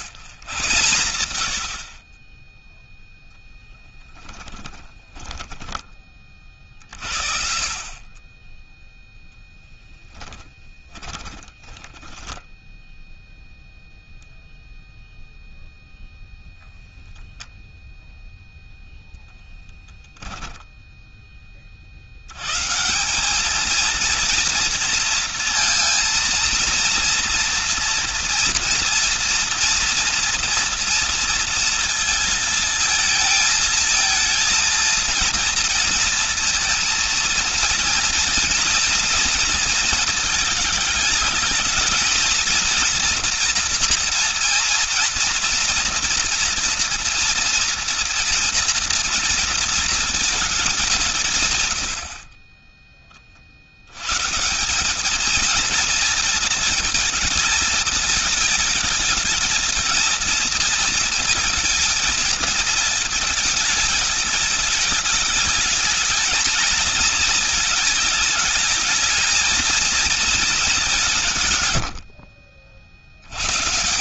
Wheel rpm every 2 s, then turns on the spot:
100, 0, 10, 50, 10, 10, 0, 0, 0, 0, 20, 200, 230, 230, 240, 230, 220, 230, 230, 230, 220, 240, 230, 230, 230, 150, 30, 210, 220, 220, 230, 220, 220, 230, 220, 190, 50.
4-6 10-12